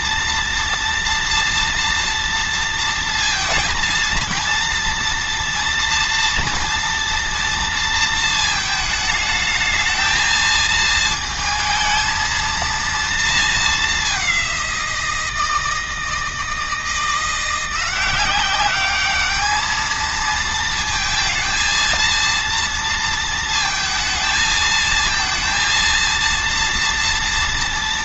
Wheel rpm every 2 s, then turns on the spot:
230, 230, 230, 230, 220, 220, 230, 170, 170, 210, 230, 230, 230, 230.
none